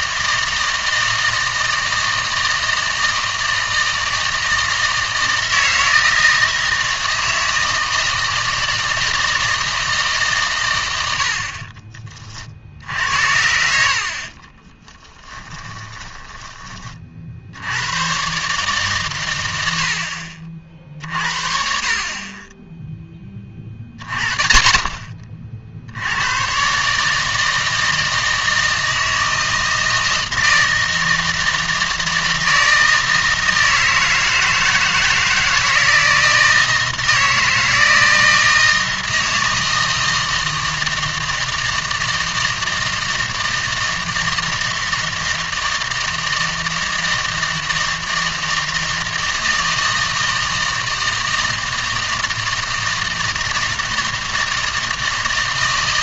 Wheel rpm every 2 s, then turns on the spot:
160, 160, 160, 160, 160, 130, 60, 20, 20, 140, 60, 20, 30, 120, 160, 160, 160, 160, 160, 160, 160, 160, 160, 160, 160, 160, 160, 160.
14-16